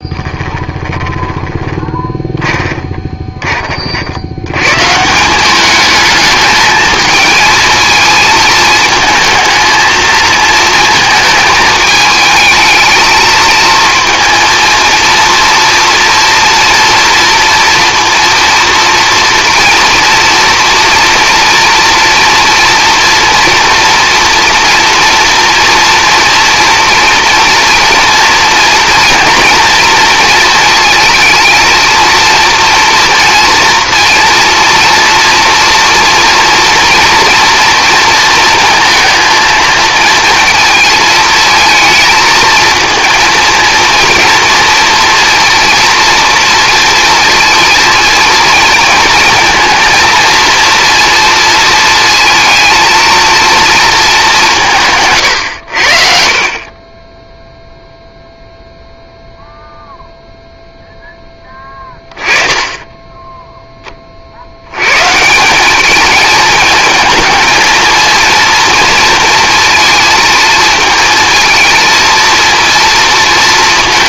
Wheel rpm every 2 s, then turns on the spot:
20, 20, 140, 220, 220, 220, 220, 230, 230, 230, 230, 230, 230, 230, 230, 230, 230, 230, 230, 230, 220, 230, 230, 230, 230, 230, 230, 140, 20, 0, 0, 10, 120, 220, 230, 230, 230.
0-4